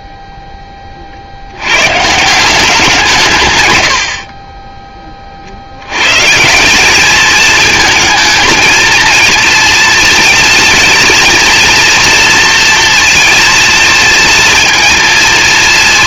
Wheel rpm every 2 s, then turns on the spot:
30, 180, 20, 200, 230, 230, 230, 230.
none